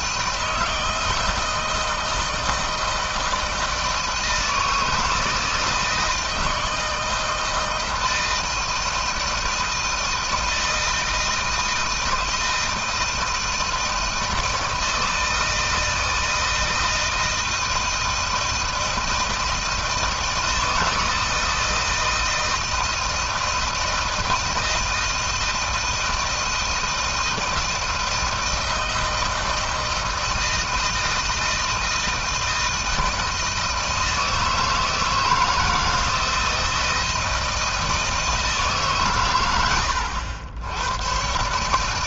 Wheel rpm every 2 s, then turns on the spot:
160, 160, 160, 160, 160, 160, 160, 160, 160, 160, 160, 160, 160, 160, 160, 160, 160, 160, 160, 140, 110.
none